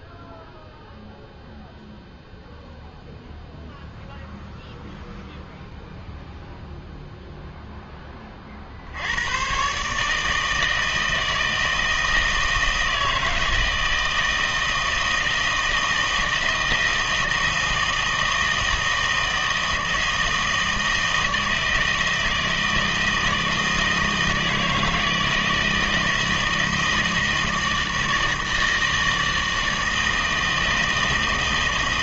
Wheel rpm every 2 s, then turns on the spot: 0, 0, 0, 0, 60, 160, 160, 160, 160, 160, 160, 160, 160, 160, 160, 160.
none